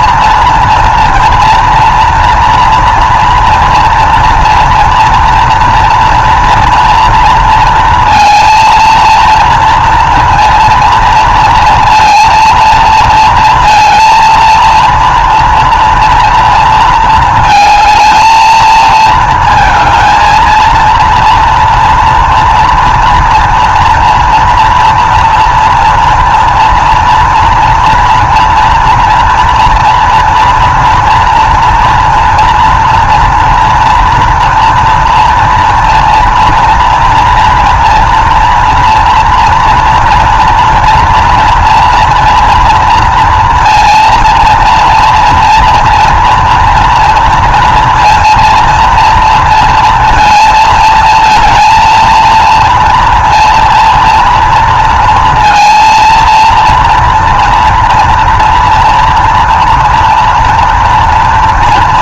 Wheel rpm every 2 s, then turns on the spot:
230, 230, 230, 230, 230, 230, 230, 230, 230, 220, 230, 230, 230, 240, 230, 230, 230, 230, 230, 230, 230, 230, 230, 230, 230, 220, 230, 230, 230, 230, 230.
none